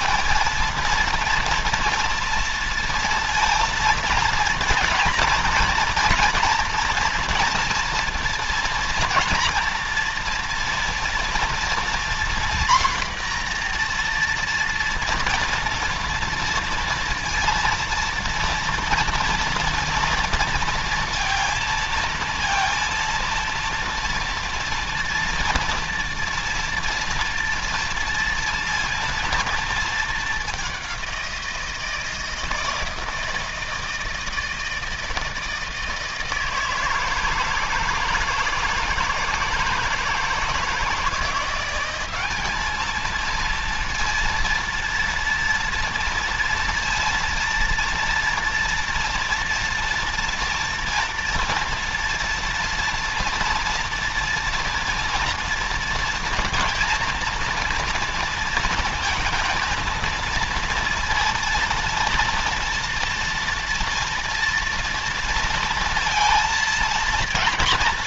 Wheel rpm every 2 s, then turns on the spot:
200, 230, 230, 230, 230, 230, 240, 240, 230, 230, 230, 230, 240, 240, 230, 200, 160, 160, 160, 160, 160, 210, 230, 230, 230, 230, 230, 230, 230, 230, 230, 230, 230, 230.
none